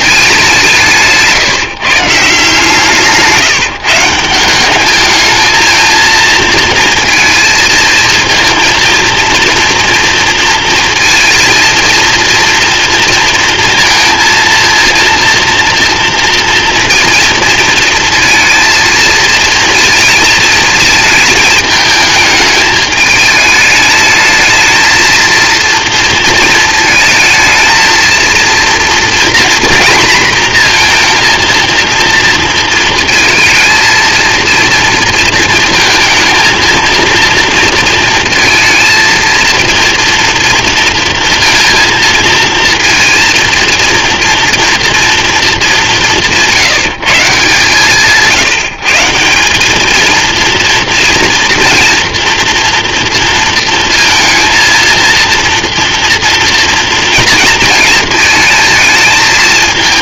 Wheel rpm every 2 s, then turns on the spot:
160, 150, 210, 230, 230, 230, 230, 230, 230, 220, 220, 210, 230, 220, 230, 230, 230, 230, 230, 230, 230, 230, 230, 160, 170, 230, 230, 230, 230, 220.
0-2